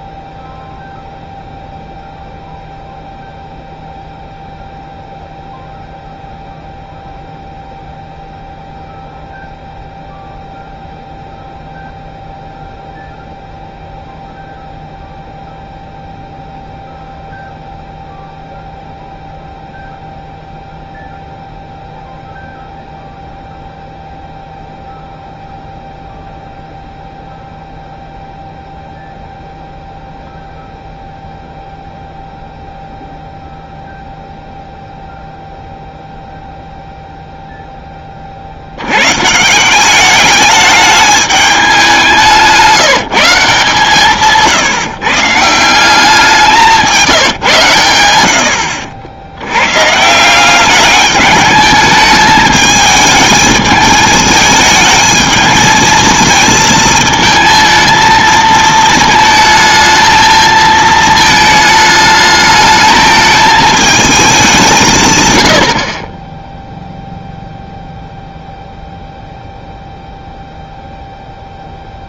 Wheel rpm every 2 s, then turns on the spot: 0, 0, 0, 0, 0, 0, 0, 0, 0, 0, 0, 0, 0, 0, 0, 0, 0, 0, 0, 80, 210, 170, 150, 170, 70, 200, 220, 220, 220, 220, 220, 220, 180, 0, 0, 0.
48-50